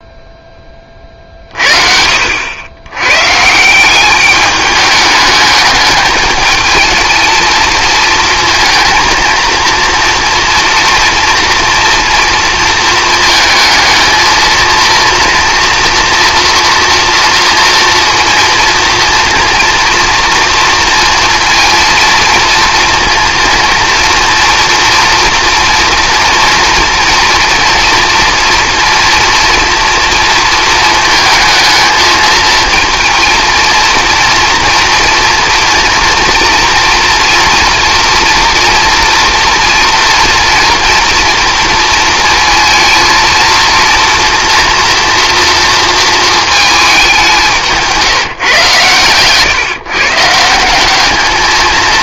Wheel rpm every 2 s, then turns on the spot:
20, 90, 210, 220, 230, 230, 230, 230, 230, 230, 230, 230, 240, 240, 230, 220, 220, 230, 230, 230, 240, 230, 230, 220, 130, 170.
none